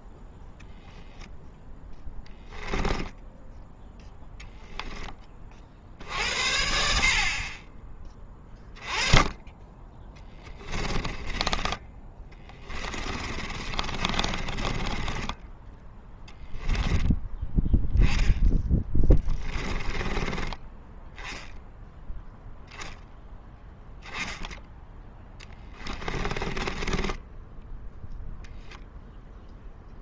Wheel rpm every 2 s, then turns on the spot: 0, 10, 10, 60, 10, 10, 20, 20, 10, 10, 20, 0, 10, 20, 0.
10-16 18-20 24-28